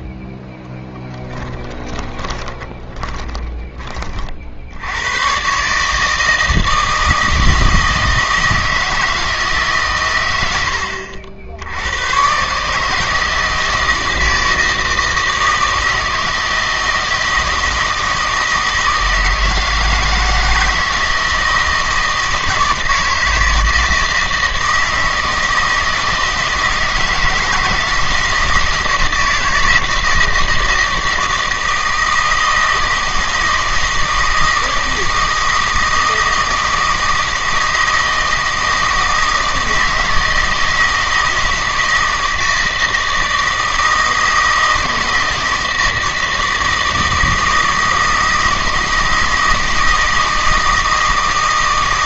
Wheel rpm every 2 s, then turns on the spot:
10, 20, 80, 160, 160, 80, 140, 160, 160, 160, 170, 160, 160, 160, 160, 160, 160, 160, 160, 160, 160, 160, 160, 160, 160, 160.
0-4